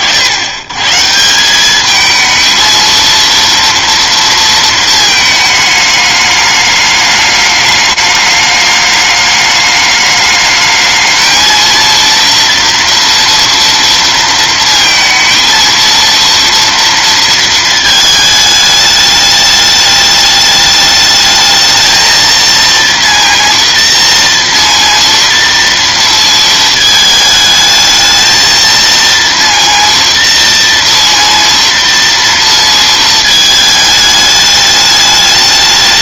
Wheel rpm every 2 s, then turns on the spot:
50, 220, 230, 210, 210, 210, 230, 230, 230, 220, 210, 220, 230, 230, 220, 230, 230, 210.
none